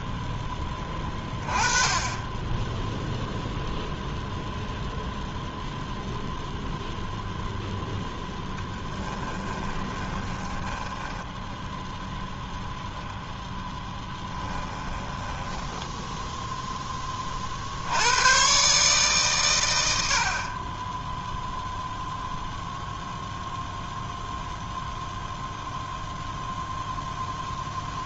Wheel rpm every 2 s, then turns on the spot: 0, 0, 0, 20, 10, 0, 10, 0, 100, 70, 0, 0, 0, 0.
6-10 12-14